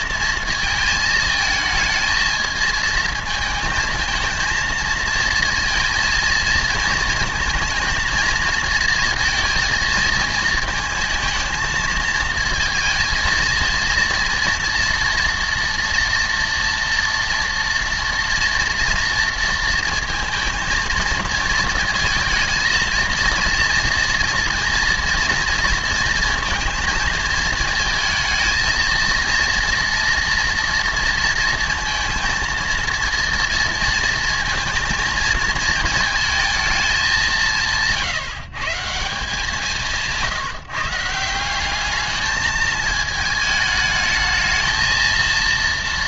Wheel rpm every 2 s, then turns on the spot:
230, 220, 220, 230, 230, 230, 230, 230, 240, 230, 230, 230, 230, 220, 220, 230, 230, 230, 230, 150, 170, 210, 220.
none